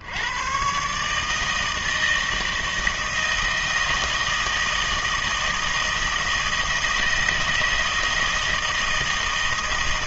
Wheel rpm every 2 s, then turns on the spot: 120, 160, 160, 170, 160.
none